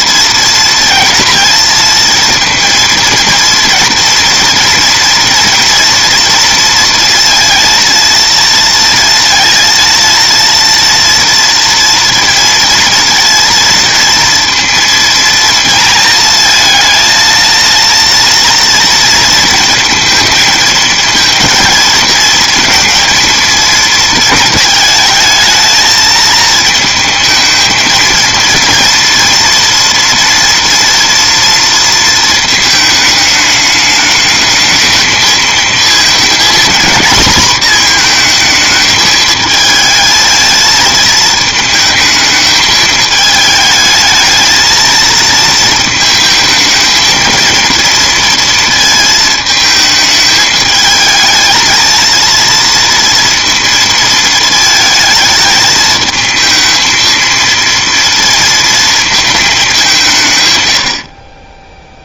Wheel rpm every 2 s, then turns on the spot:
230, 230, 230, 230, 230, 230, 230, 230, 220, 230, 230, 230, 220, 220, 230, 240, 220, 220, 230, 220, 220, 220, 220, 220, 220, 220, 230, 220, 220, 230, 100.
none